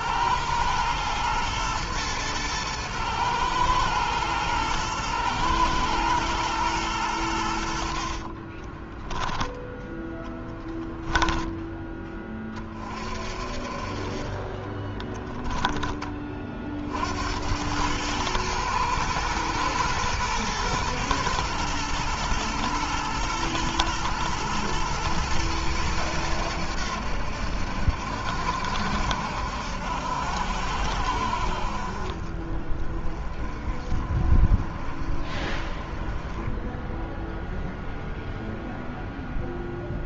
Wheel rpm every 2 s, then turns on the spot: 110, 110, 110, 110, 20, 10, 30, 20, 50, 110, 110, 110, 110, 90, 70, 80, 40, 40, 10, 0.
8-12 14-16